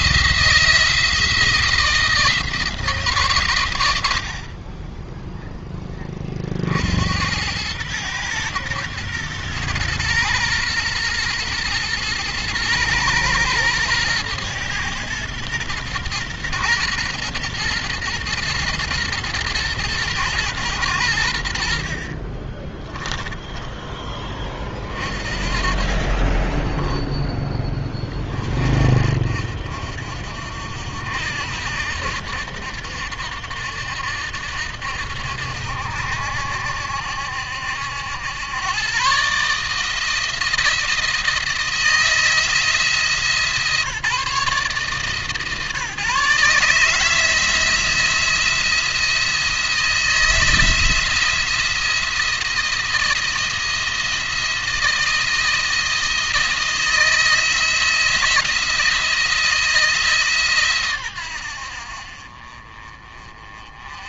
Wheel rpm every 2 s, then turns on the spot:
160, 160, 30, 60, 120, 120, 120, 120, 120, 120, 100, 20, 30, 20, 30, 60, 80, 70, 70, 110, 160, 160, 150, 150, 170, 170, 170, 160, 160, 170, 130, 40.
22-24 26-28